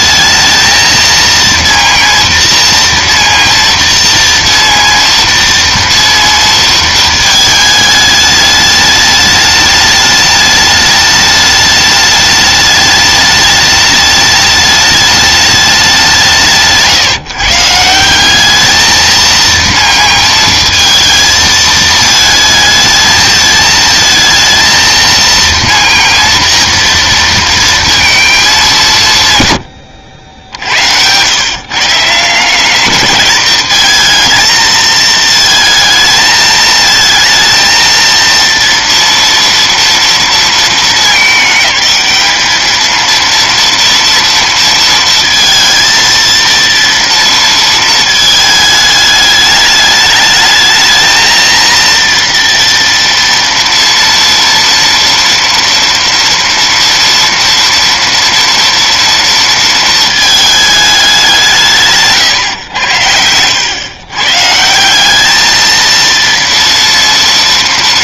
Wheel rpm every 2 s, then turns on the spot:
220, 230, 230, 230, 210, 210, 210, 210, 160, 210, 230, 220, 220, 230, 210, 90, 190, 230, 220, 230, 210, 220, 230, 230, 210, 220, 230, 230, 230, 230, 210, 100, 150, 230.
none